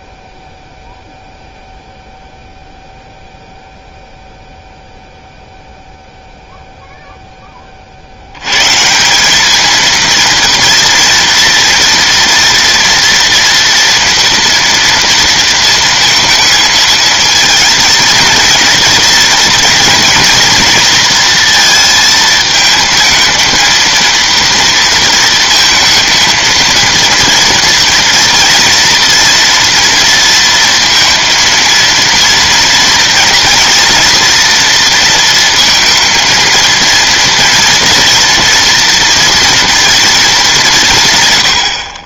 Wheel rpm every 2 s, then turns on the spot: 0, 0, 0, 10, 190, 230, 230, 230, 230, 230, 230, 230, 220, 230, 230, 230, 240, 230, 230, 230, 120.
none